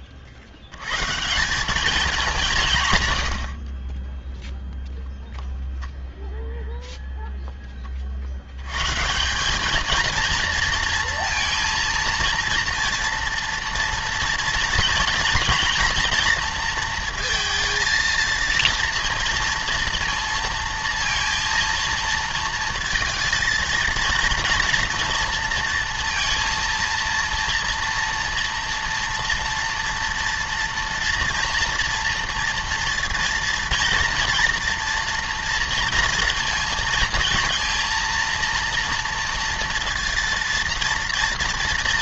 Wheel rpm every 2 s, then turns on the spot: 90, 150, 0, 0, 100, 230, 230, 230, 230, 230, 230, 230, 230, 230, 240, 230, 230, 230, 230, 230, 230.
none